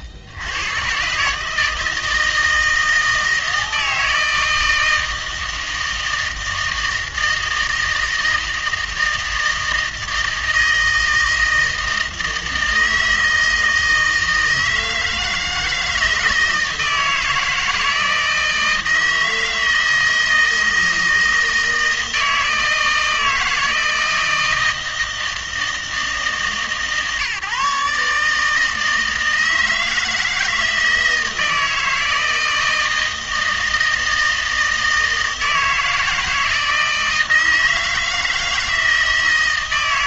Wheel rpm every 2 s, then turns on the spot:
100, 160, 160, 160, 160, 160, 160, 160, 160, 160, 160, 160, 160, 150, 160, 160, 160, 160, 160, 160.
none